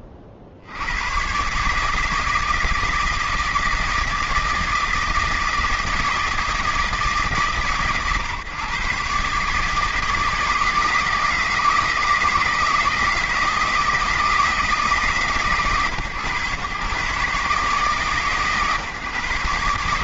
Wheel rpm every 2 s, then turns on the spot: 90, 160, 160, 160, 140, 160, 160, 160, 130, 140.
none